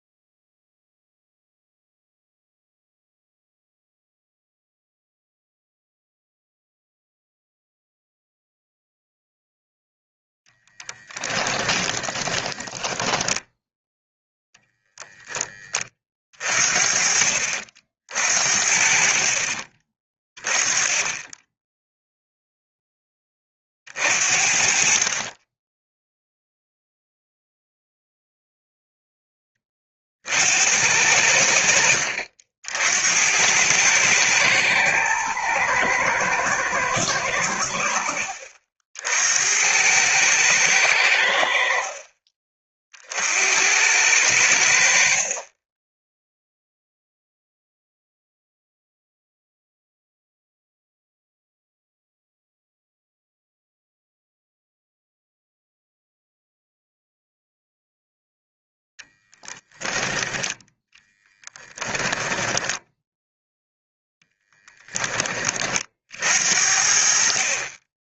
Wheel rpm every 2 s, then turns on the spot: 0, 0, 0, 0, 0, 10, 10, 0, 50, 50, 20, 10, 50, 0, 0, 80, 70, 110, 110, 60, 100, 40, 70, 0, 0, 0, 0, 0, 0, 0, 10, 10, 10, 70.
12-14 62-64